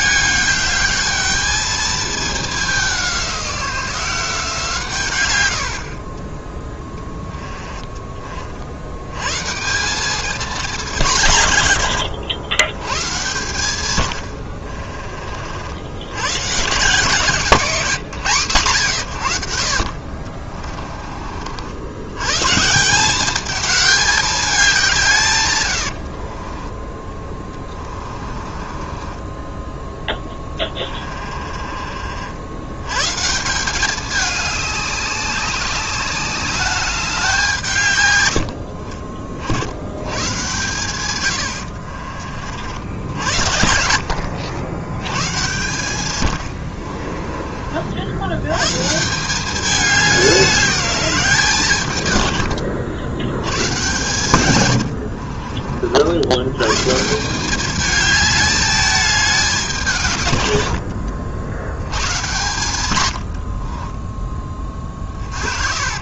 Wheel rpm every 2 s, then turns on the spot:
210, 200, 160, 20, 70, 200, 110, 60, 160, 150, 30, 160, 190, 20, 30, 20, 100, 200, 200, 70, 120, 70, 110, 60, 130, 200, 80, 100, 130, 210, 90, 120, 30.
14-16 20-22 26-32 46-48 54-56 64-66